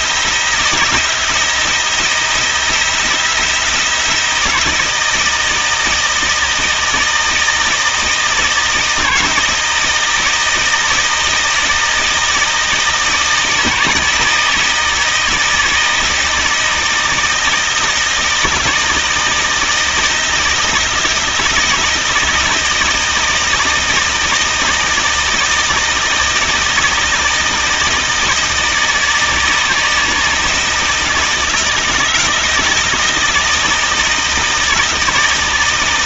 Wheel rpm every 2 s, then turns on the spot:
170, 170, 170, 160, 160, 160, 160, 160, 160, 160, 160, 160, 160, 160, 160, 160, 160, 160.
none